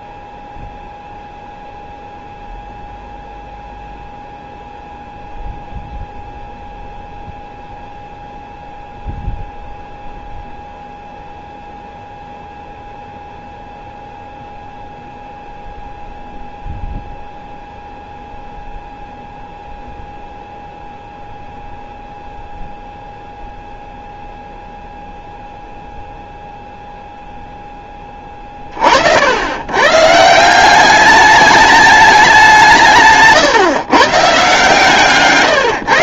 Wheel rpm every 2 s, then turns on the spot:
0, 0, 0, 0, 0, 0, 0, 0, 0, 0, 0, 0, 0, 0, 50, 190, 180, 150.
none